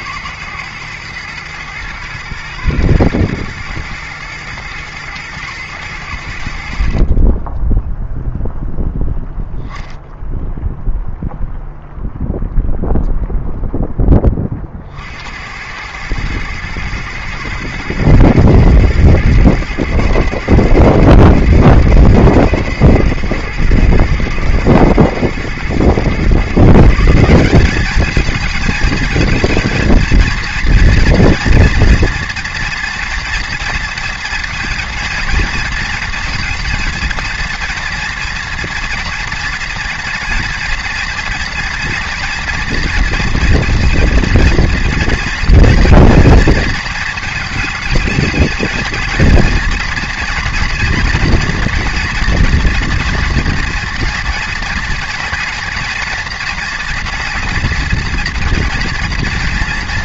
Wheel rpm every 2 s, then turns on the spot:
120, 110, 110, 50, 0, 0, 0, 50, 120, 120, 120, 110, 120, 160, 230, 230, 230, 230, 230, 240, 230, 230, 240, 230, 230, 230, 230, 230, 240, 230.
none